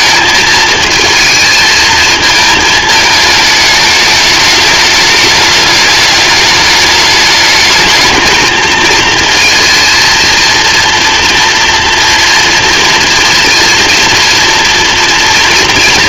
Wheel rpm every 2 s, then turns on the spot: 220, 220, 210, 210, 230, 230, 230, 240.
none